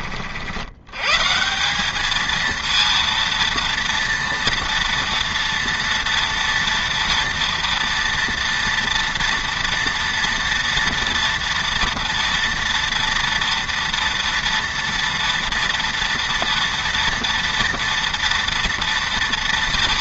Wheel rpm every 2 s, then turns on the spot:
90, 230, 240, 230, 230, 230, 230, 240, 230, 230.
none